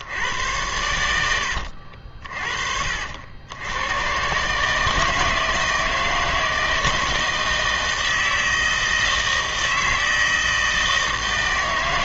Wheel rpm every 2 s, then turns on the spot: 100, 50, 150, 160, 160, 160.
none